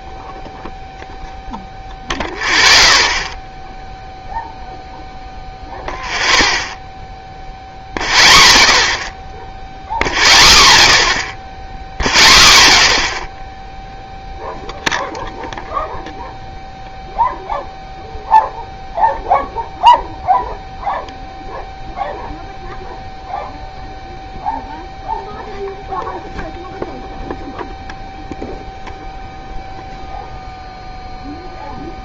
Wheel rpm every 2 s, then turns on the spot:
0, 0, 0, 0, 0, 0, 0, 0, 0, 0, 0, 0, 0, 0, 0, 0.
none